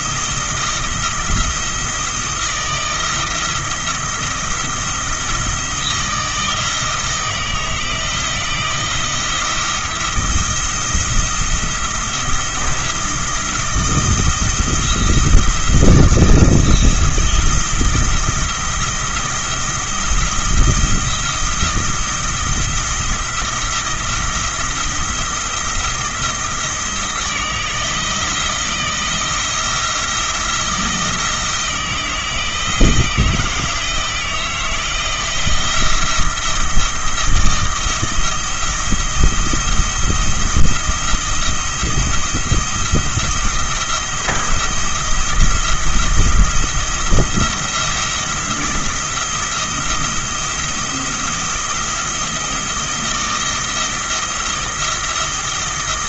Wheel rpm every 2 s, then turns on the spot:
170, 170, 170, 160, 170, 170, 170, 170, 160, 170, 170, 170, 170, 170, 170, 160, 160, 170, 170, 170, 170, 170, 170, 170, 170, 170, 170, 170.
none